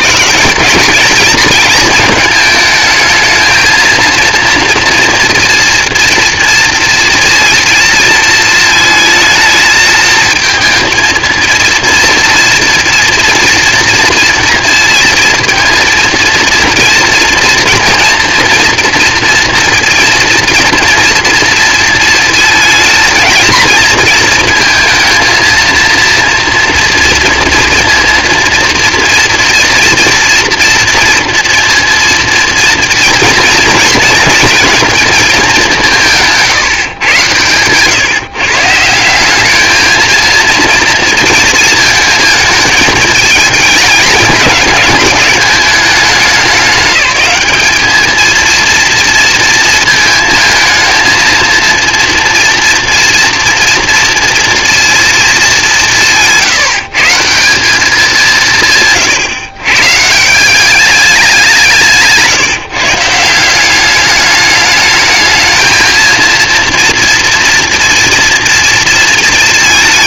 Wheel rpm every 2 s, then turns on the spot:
190, 220, 230, 230, 220, 220, 230, 230, 230, 230, 230, 230, 230, 230, 230, 230, 230, 230, 150, 140, 230, 220, 220, 190, 230, 220, 230, 230, 160, 160, 200, 160, 210, 230, 230.
none